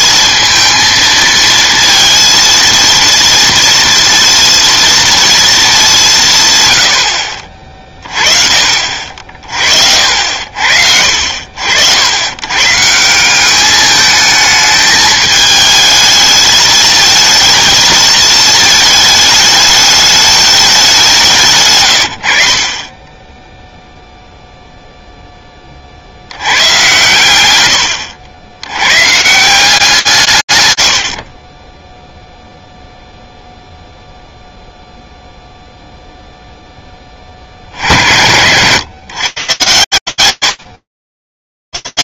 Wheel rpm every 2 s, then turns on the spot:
230, 230, 230, 90, 50, 60, 150, 220, 220, 220, 190, 30, 0, 120, 120, 50, 0, 0, 10, 110, 40.
none